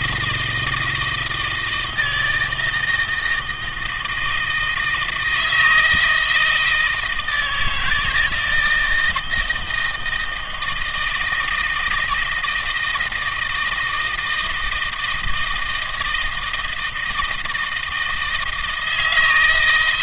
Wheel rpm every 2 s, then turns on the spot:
160, 160, 160, 160, 160, 160, 160, 160, 160, 160.
none